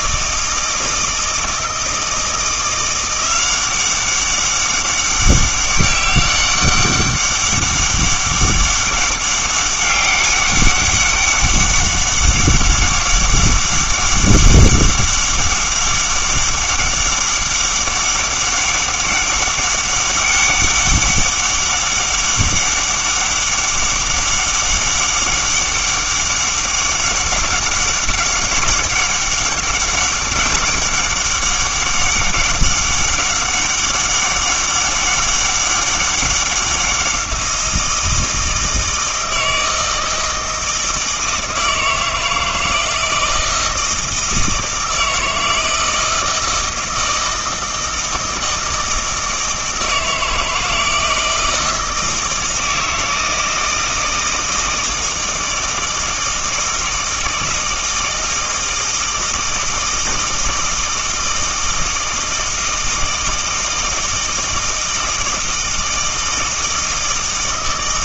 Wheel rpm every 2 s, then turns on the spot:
160, 170, 200, 200, 200, 200, 200, 200, 200, 200, 200, 200, 200, 200, 200, 200, 200, 200, 190, 160, 160, 160, 160, 160, 160, 160, 160, 160, 160, 160, 160, 160, 160, 160.
none